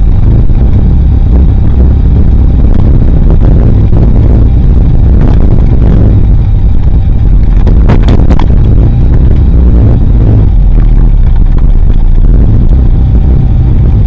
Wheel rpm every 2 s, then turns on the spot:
0, 0, 0, 0, 0, 0, 0.
none